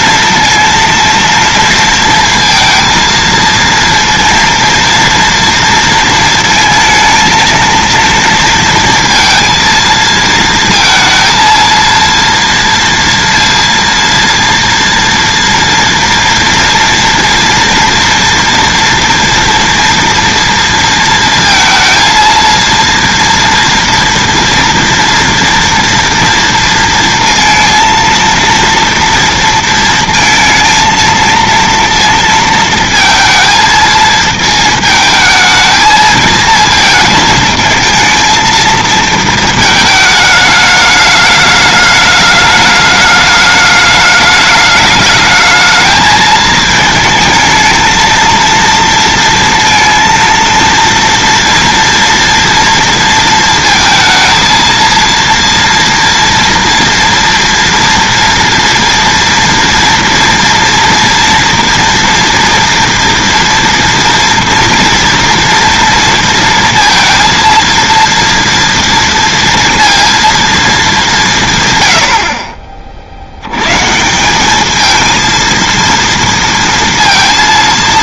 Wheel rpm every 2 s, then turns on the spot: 230, 230, 230, 220, 230, 230, 230, 230, 230, 230, 230, 230, 230, 230, 230, 230, 230, 220, 220, 230, 210, 210, 210, 220, 230, 230, 230, 230, 230, 230, 230, 230, 230, 230, 230, 220, 50, 210, 230.
none